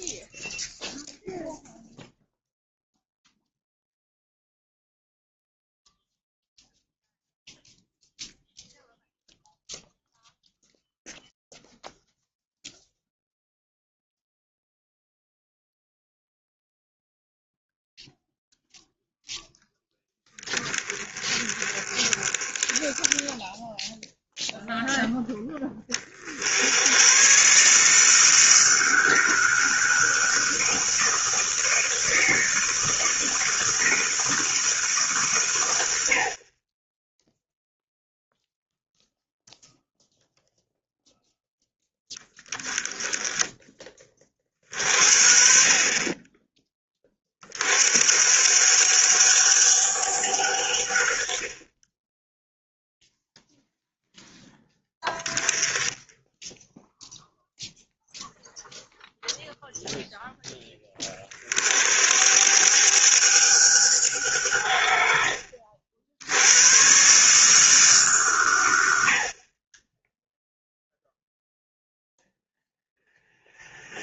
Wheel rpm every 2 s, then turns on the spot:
0, 0, 0, 0, 0, 0, 0, 0, 0, 0, 20, 20, 0, 100, 160, 160, 160, 150, 20, 0, 0, 10, 50, 20, 90, 70, 0, 20, 0, 0, 30, 100, 70, 110, 80, 0, 0.
none